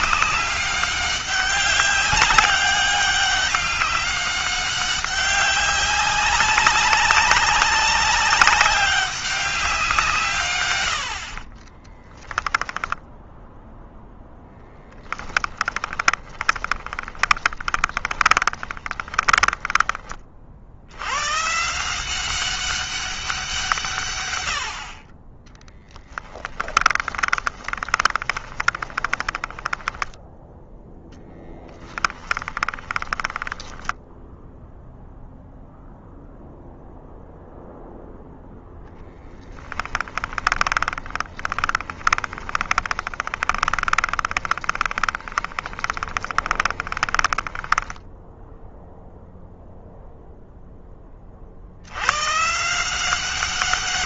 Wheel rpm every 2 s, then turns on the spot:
200, 200, 200, 190, 200, 100, 10, 10, 20, 10, 80, 190, 70, 10, 20, 10, 20, 0, 0, 0, 30, 20, 20, 20, 0, 20, 170.
12-20 26-34 40-48